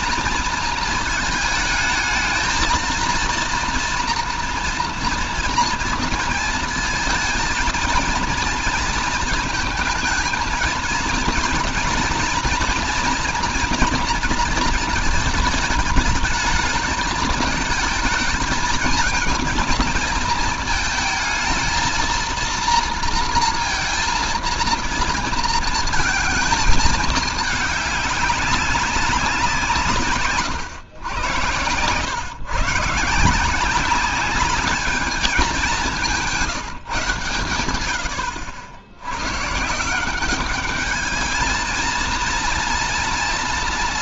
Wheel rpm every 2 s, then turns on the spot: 220, 230, 230, 220, 230, 230, 230, 230, 220, 220, 220, 230, 230, 220, 190, 110, 150, 210, 140, 80, 210, 230.
none